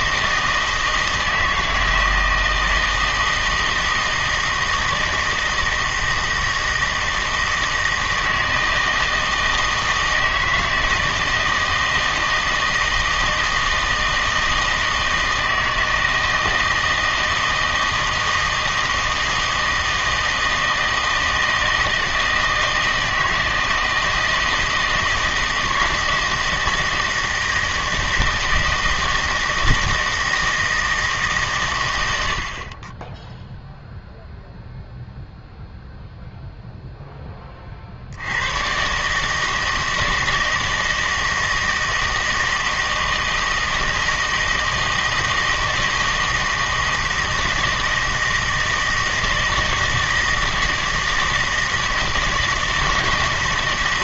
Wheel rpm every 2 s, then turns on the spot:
160, 160, 160, 160, 160, 160, 160, 160, 160, 160, 160, 160, 160, 160, 160, 160, 30, 0, 0, 110, 160, 160, 160, 160, 160, 160, 160.
none